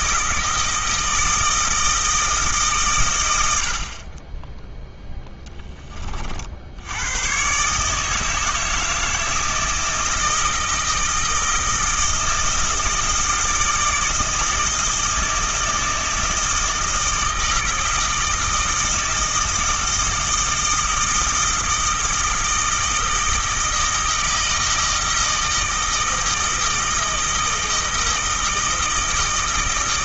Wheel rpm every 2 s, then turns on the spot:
160, 130, 0, 70, 160, 160, 160, 160, 160, 160, 160, 160, 160, 160, 160.
none